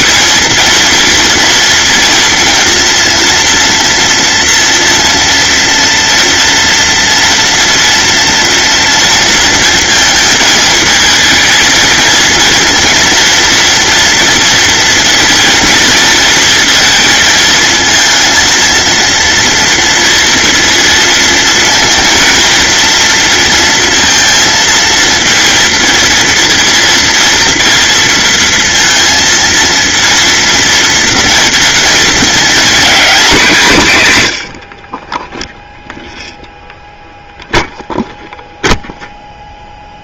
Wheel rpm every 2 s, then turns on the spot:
230, 230, 230, 230, 230, 220, 230, 230, 230, 230, 230, 230, 230, 230, 230, 230, 240, 40, 0, 0.
none